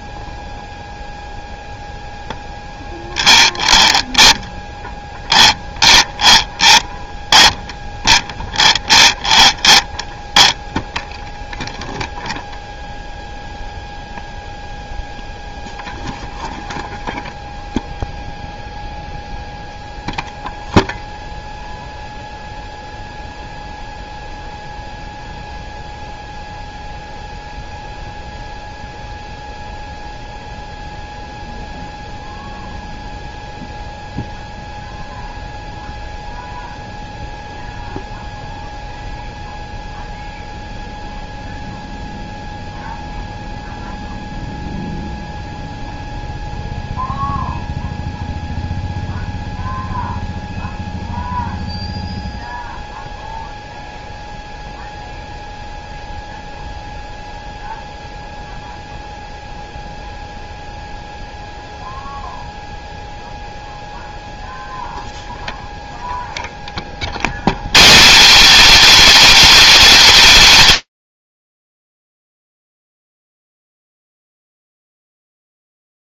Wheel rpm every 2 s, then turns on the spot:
0, 0, 0, 0, 0, 0, 0, 0, 0, 0, 0, 0, 0, 0, 0, 0, 0, 0, 0, 0, 0, 0, 0, 0, 0, 0, 0, 0, 0, 0, 0, 0, 0, 40, 350, 260, 0, 10.
none